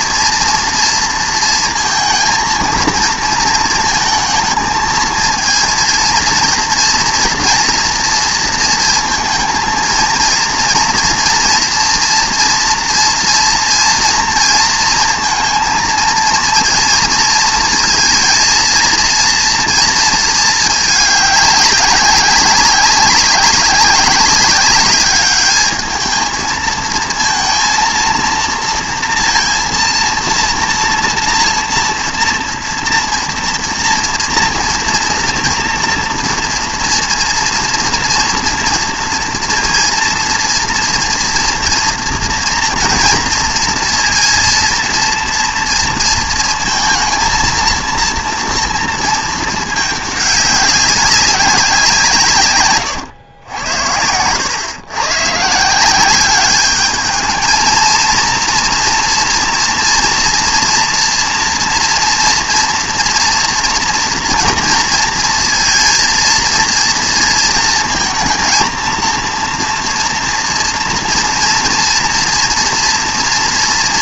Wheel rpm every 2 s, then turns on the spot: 230, 230, 220, 230, 230, 230, 230, 230, 230, 230, 220, 190, 200, 220, 230, 230, 230, 240, 230, 230, 230, 230, 230, 230, 230, 200, 120, 120, 210, 230, 230, 230, 230, 230, 230, 230, 230.
52-54